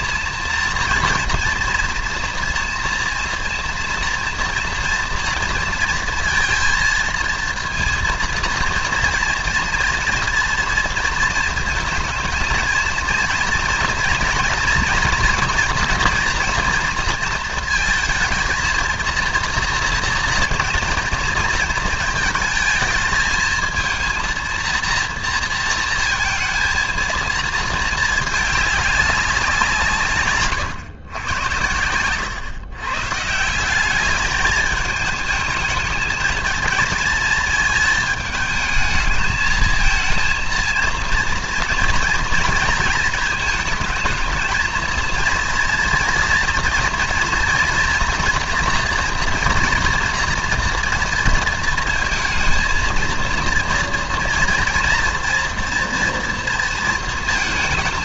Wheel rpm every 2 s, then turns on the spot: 230, 230, 230, 230, 230, 230, 230, 230, 230, 230, 230, 220, 230, 230, 200, 120, 120, 210, 220, 220, 230, 230, 220, 230, 240, 230, 220, 230, 230.
none